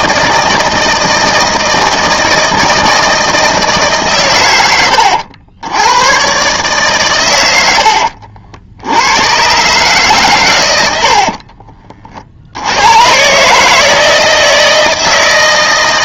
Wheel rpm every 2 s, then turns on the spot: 160, 160, 100, 130, 70, 100, 80, 160.
none